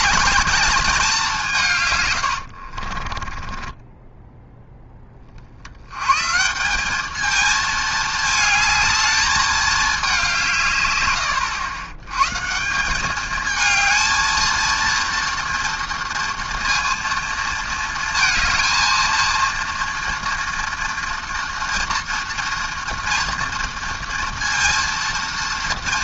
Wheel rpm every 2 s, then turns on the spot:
210, 60, 10, 190, 220, 140, 180, 230, 230, 230, 230, 230, 230.
2-4